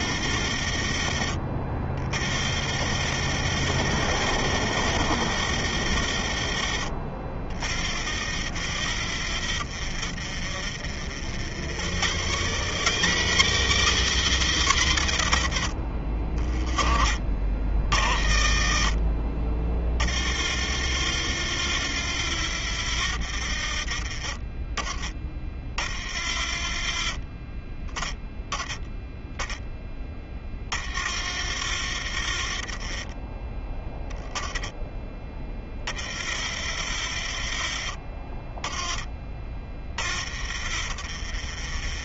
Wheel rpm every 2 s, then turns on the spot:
40, 40, 50, 40, 30, 30, 80, 130, 30, 50, 30, 40, 20, 30, 10, 20, 40, 10, 30, 20, 30.
none